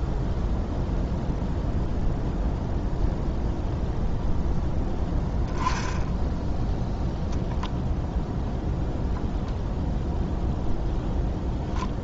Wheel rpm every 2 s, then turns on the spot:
0, 0, 10, 0, 0, 0.
none